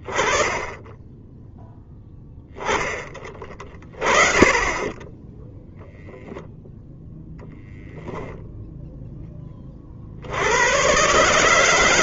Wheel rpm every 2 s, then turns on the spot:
20, 20, 10, 0, 0, 110.
none